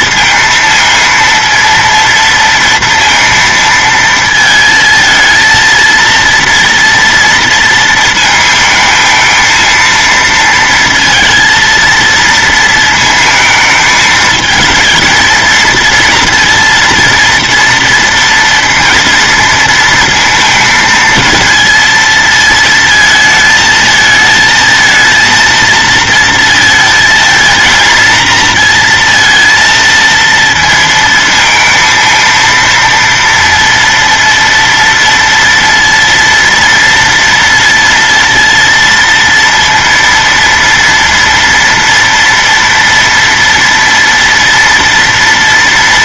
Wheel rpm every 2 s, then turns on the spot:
230, 230, 220, 230, 220, 230, 220, 220, 230, 230, 230, 220, 230, 230, 230, 230, 230, 230, 230, 230, 230, 230, 230.
none